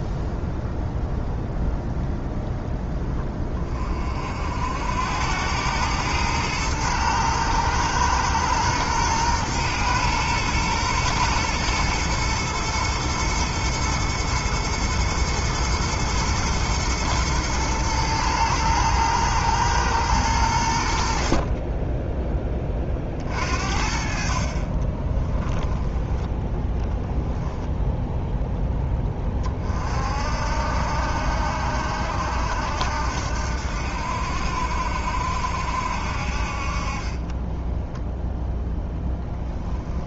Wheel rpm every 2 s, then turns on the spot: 0, 0, 70, 110, 120, 120, 120, 110, 110, 110, 90, 20, 40, 10, 10, 70, 80, 70, 50, 0.
none